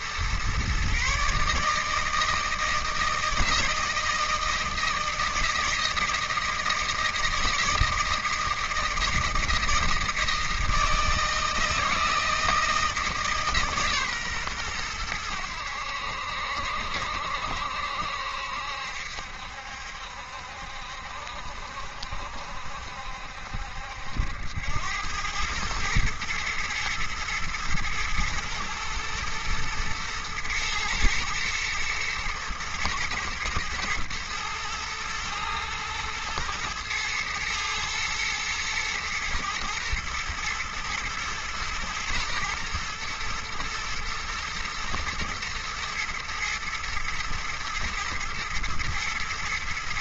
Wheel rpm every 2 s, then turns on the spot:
130, 160, 160, 160, 160, 160, 160, 110, 70, 70, 70, 70, 90, 120, 110, 110, 110, 110, 110, 110, 120, 110, 120, 120, 110.
none